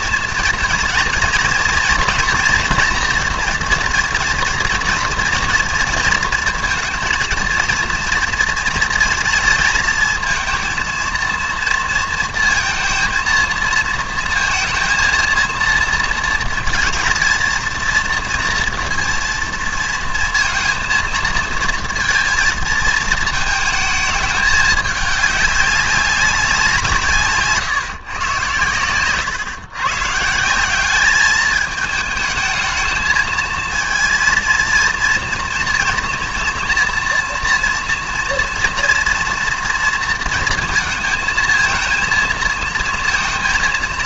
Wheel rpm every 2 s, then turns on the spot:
230, 230, 230, 230, 230, 230, 230, 230, 230, 230, 230, 220, 210, 180, 120, 190, 220, 230, 230, 230, 220, 230.
none